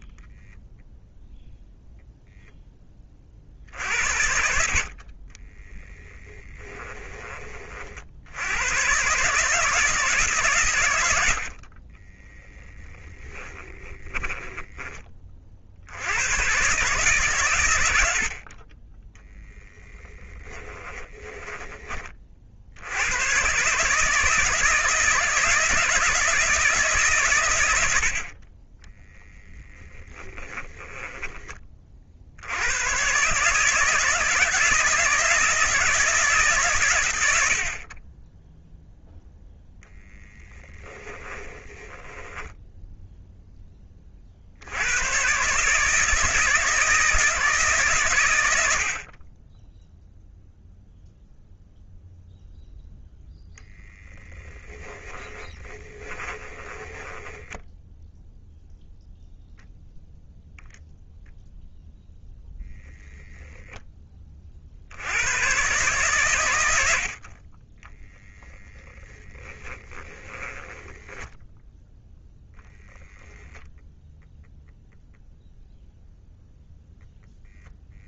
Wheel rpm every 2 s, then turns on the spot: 0, 30, 40, 20, 130, 100, 20, 20, 140, 20, 20, 90, 160, 150, 10, 10, 110, 160, 130, 0, 10, 0, 100, 160, 60, 0, 0, 10, 20, 0, 10, 0, 70, 80, 10, 10, 0, 0, 0.
12-14 20-22 30-32 40-42 54-58 68-72